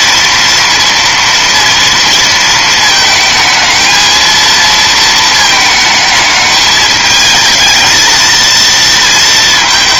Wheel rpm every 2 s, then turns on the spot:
230, 220, 220, 220, 230.
none